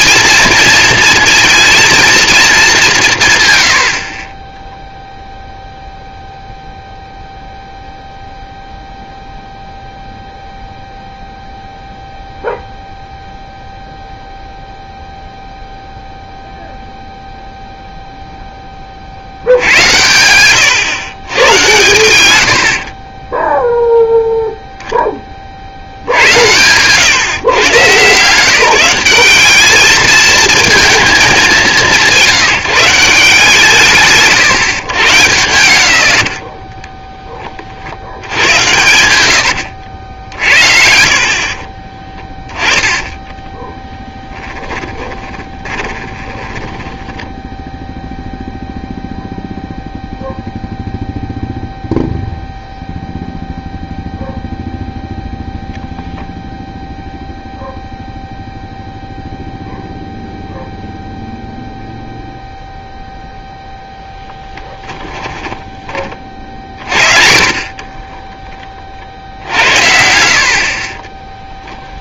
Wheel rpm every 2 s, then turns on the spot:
230, 200, 0, 0, 0, 0, 0, 0, 0, 20, 110, 80, 0, 100, 170, 220, 160, 130, 40, 90, 60, 20, 10, 20, 0, 0, 0, 0, 0, 0, 0, 0, 10, 50, 30, 50.
36-40 42-48 64-66 70-72